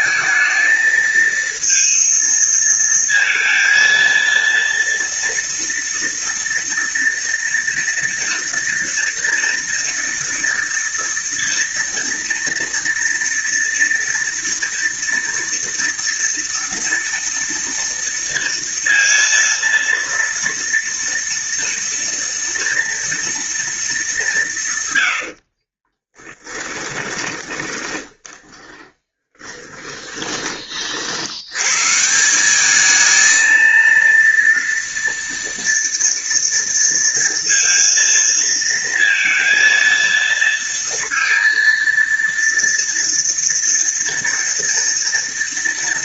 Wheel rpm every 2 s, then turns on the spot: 220, 230, 230, 230, 230, 230, 230, 230, 230, 230, 230, 230, 130, 20, 20, 50, 210, 230, 230, 230, 230, 230, 230.
26-30